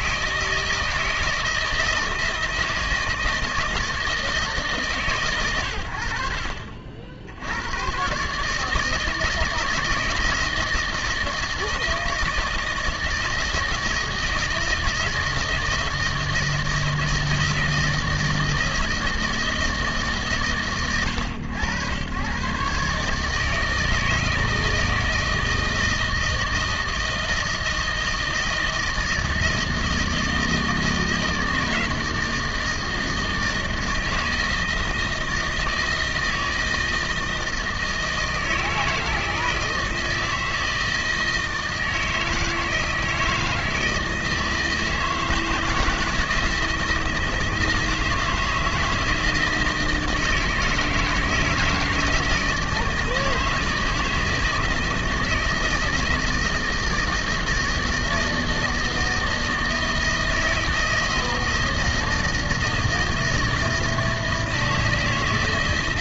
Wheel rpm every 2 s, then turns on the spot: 160, 160, 160, 70, 150, 160, 170, 160, 160, 160, 120, 130, 160, 160, 160, 160, 160, 160, 160, 160, 160, 160, 160, 160, 160, 160, 160, 160, 160, 160, 160, 160, 160.
none